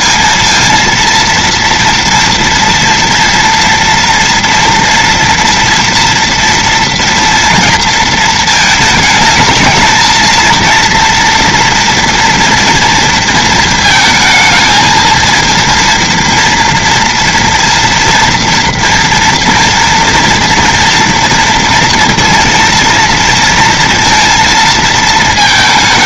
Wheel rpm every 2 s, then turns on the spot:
220, 230, 230, 230, 230, 220, 230, 220, 230, 230, 230, 230, 230.
none